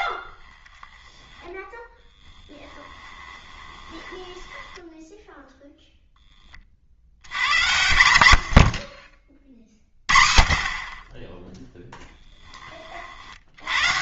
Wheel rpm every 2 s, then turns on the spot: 30, 20, 10, 30, 70, 50, 20.
0-6 8-10